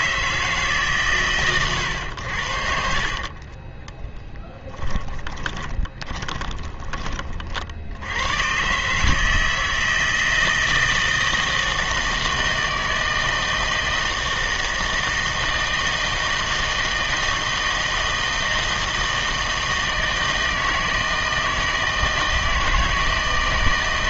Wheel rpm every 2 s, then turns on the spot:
150, 70, 10, 20, 130, 160, 160, 160, 160, 160, 160, 160.
4-8